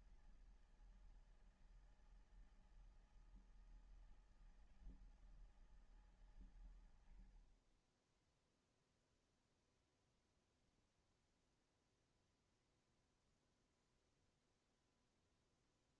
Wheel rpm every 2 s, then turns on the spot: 160, 160, 160, 130, 10, 0, 0, 0.
none